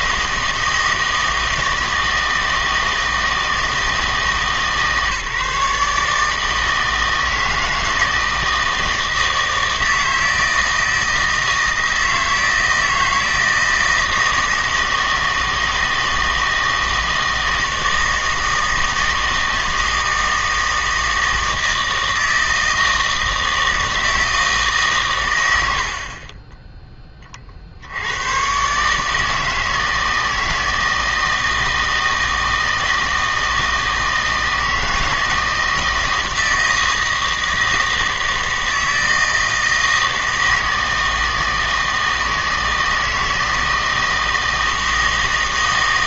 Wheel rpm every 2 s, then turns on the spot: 160, 160, 150, 160, 160, 160, 160, 160, 160, 160, 160, 160, 150, 20, 140, 160, 160, 160, 160, 160, 160, 160, 160.
none